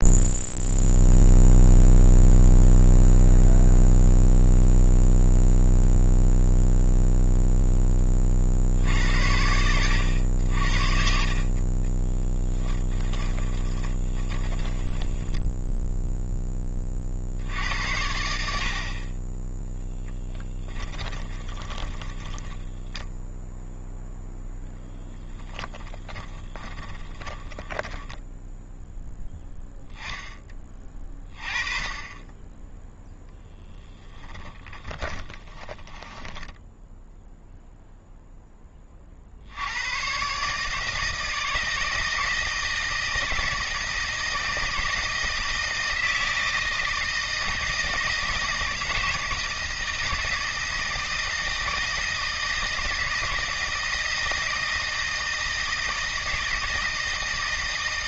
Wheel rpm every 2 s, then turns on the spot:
0, 0, 0, 0, 60, 60, 10, 20, 20, 60, 20, 10, 0, 20, 0, 20, 10, 20, 10, 20, 150, 160, 170, 160, 160, 160, 160, 160, 160.
10-16 20-24 26-28 34-36